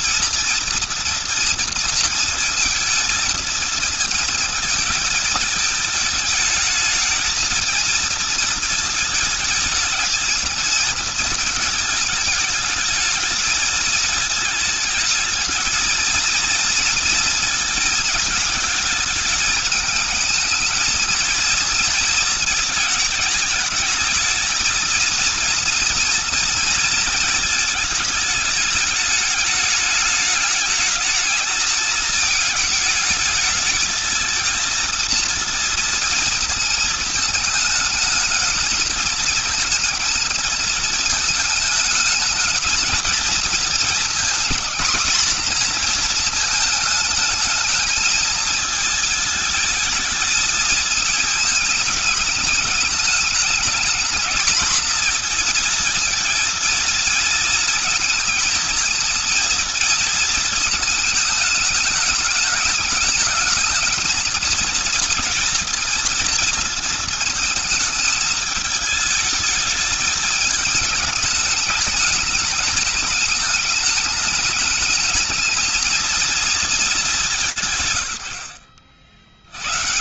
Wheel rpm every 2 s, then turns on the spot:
230, 230, 230, 220, 220, 220, 220, 220, 230, 220, 220, 220, 220, 230, 220, 210, 220, 230, 230, 220, 230, 220, 220, 220, 220, 230, 210, 220, 230, 230, 220, 220, 220, 230, 210, 220, 220, 210, 210, 80.
none